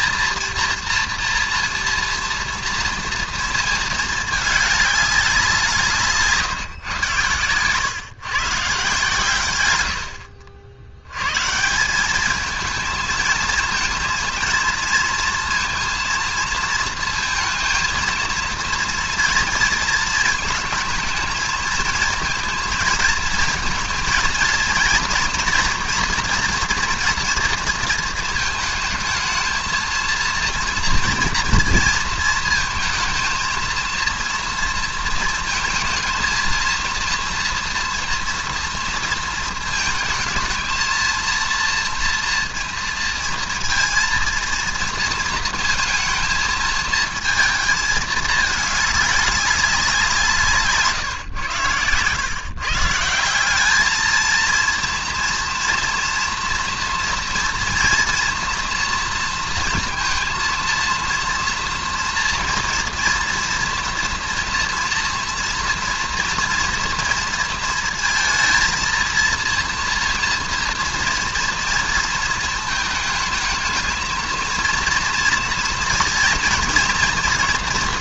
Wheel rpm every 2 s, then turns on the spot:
230, 230, 210, 150, 140, 70, 220, 230, 230, 230, 220, 220, 230, 230, 220, 230, 220, 230, 230, 230, 220, 230, 230, 230, 210, 150, 140, 230, 230, 240, 230, 230, 230, 240, 230, 230, 220, 230, 230.
none